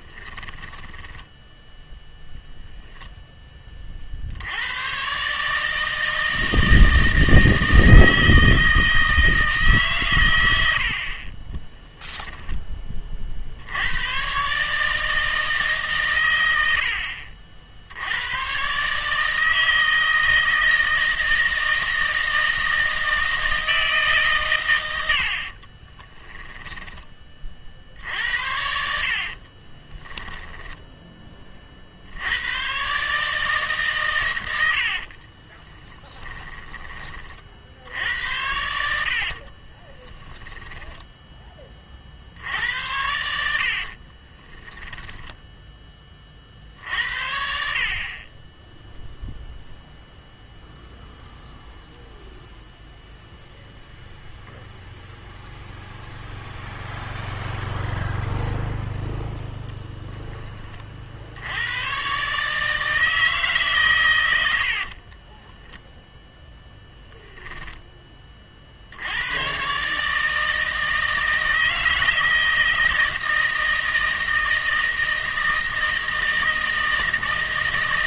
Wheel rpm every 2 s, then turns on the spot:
20, 0, 110, 160, 160, 80, 20, 150, 80, 140, 160, 160, 100, 10, 70, 10, 130, 80, 20, 80, 10, 80, 10, 50, 10, 0, 0, 0, 0, 0, 40, 160, 50, 0, 60, 160, 160, 160, 160.
0-2 28-30 34-36 40-42 44-46 64-66